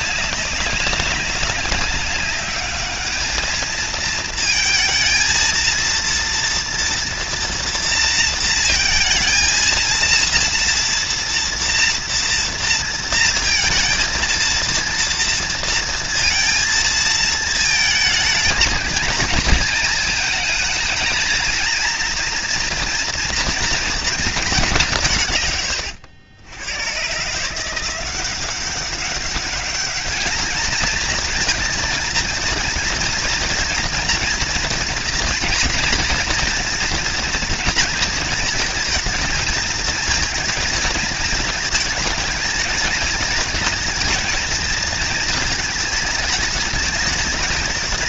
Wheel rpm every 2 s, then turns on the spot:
200, 210, 230, 240, 230, 230, 230, 230, 220, 220, 220, 230, 150, 120, 200, 230, 240, 230, 240, 230, 220, 220, 230, 220.
none